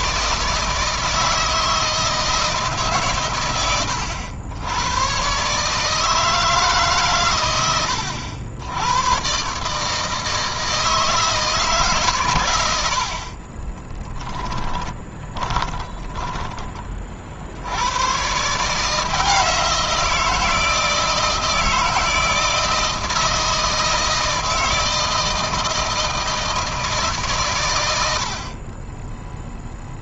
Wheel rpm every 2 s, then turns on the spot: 160, 130, 120, 140, 110, 160, 80, 20, 40, 160, 160, 160, 160, 150, 20.
14-16